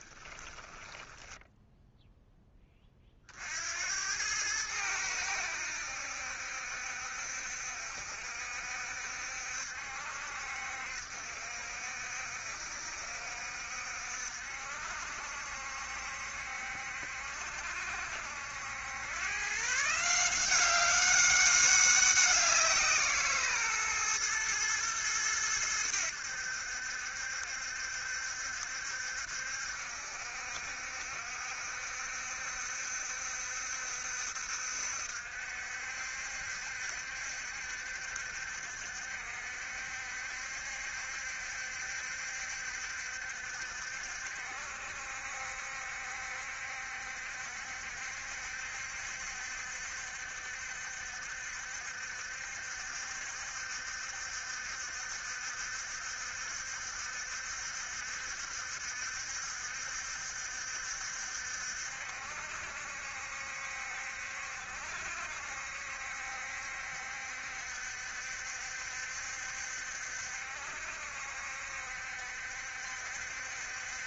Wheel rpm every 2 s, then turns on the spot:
10, 30, 100, 70, 70, 60, 70, 60, 60, 90, 190, 170, 110, 70, 70, 70, 70, 60, 70, 60, 70, 70, 60, 70, 70, 70, 70, 60, 70, 70, 70, 60, 60, 70, 70, 60, 70.
0-2